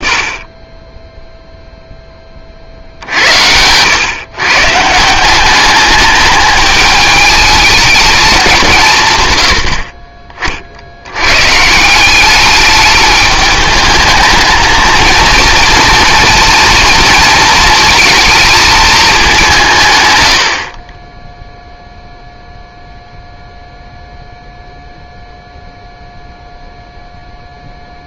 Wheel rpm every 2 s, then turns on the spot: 10, 60, 140, 210, 180, 60, 210, 220, 230, 220, 40, 0, 0, 0.
none